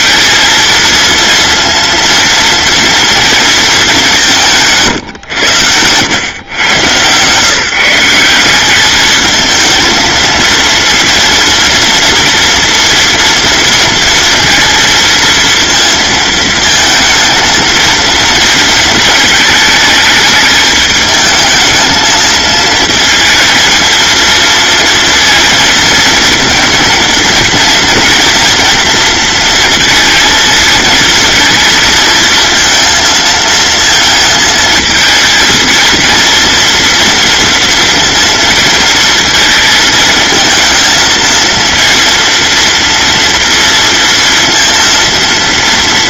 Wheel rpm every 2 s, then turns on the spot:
230, 230, 140, 130, 190, 230, 230, 230, 230, 230, 220, 220, 230, 230, 230, 220, 230, 220, 230, 230, 220, 230, 230.
none